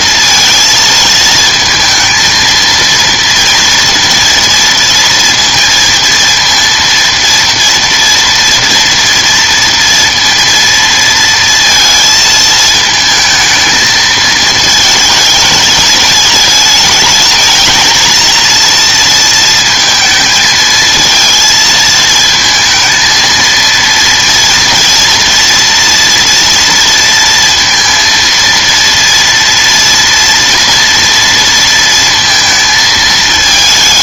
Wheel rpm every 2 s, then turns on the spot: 230, 230, 230, 230, 230, 230, 220, 220, 220, 230, 220, 220, 230, 230, 230, 230, 230.
none